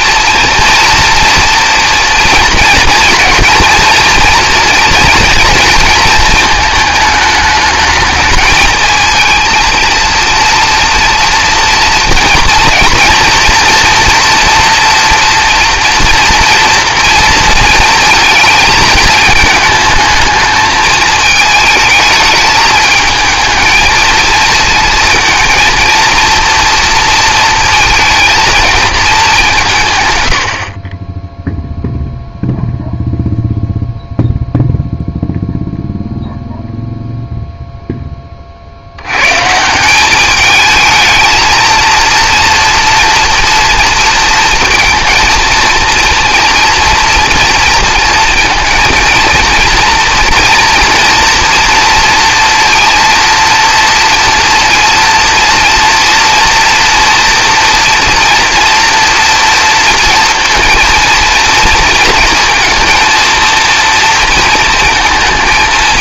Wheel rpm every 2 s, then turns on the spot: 230, 230, 230, 220, 220, 230, 240, 240, 230, 220, 220, 220, 220, 240, 220, 50, 0, 0, 0, 50, 220, 240, 230, 230, 230, 230, 230, 230, 230, 230, 230, 230, 230.
none